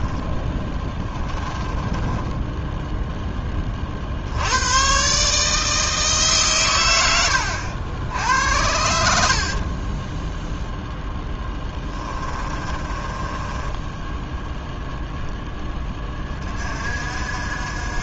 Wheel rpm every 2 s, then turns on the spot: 20, 10, 110, 120, 80, 0, 20, 0, 50.
0-4 12-14